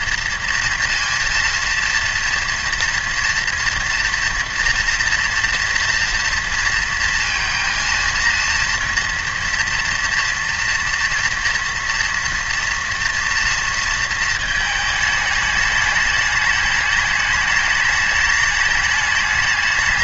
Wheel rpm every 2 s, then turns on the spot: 230, 230, 240, 230, 240, 230, 230, 220, 210, 210.
none